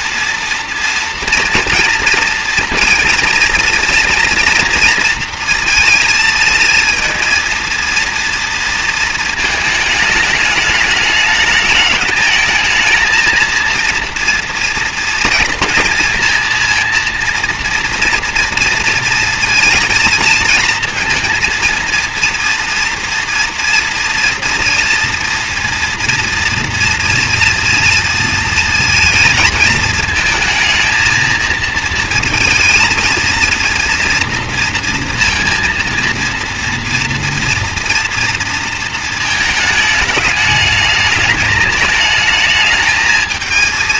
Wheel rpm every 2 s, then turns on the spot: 230, 230, 230, 230, 230, 210, 220, 230, 230, 230, 230, 230, 230, 230, 230, 220, 230, 230, 230, 220, 210, 220.
none